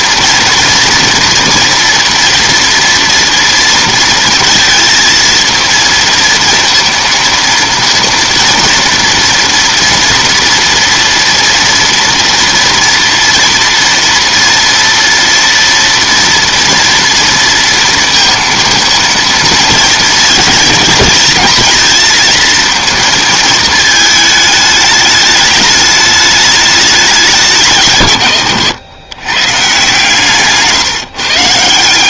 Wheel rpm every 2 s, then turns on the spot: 230, 230, 230, 230, 230, 230, 230, 230, 230, 230, 220, 230, 210, 210, 120, 150.
none